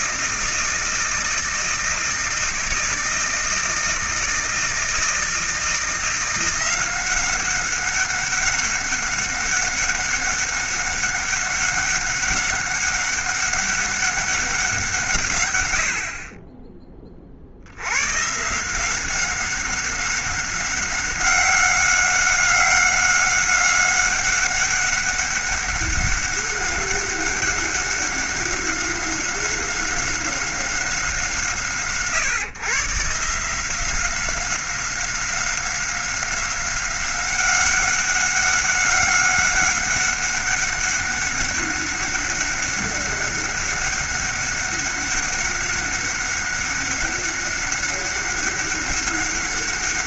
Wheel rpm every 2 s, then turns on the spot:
160, 160, 160, 180, 190, 200, 200, 170, 20, 170, 190, 200, 200, 200, 190, 190, 130, 190, 190, 190, 200, 190, 200, 190, 200.
none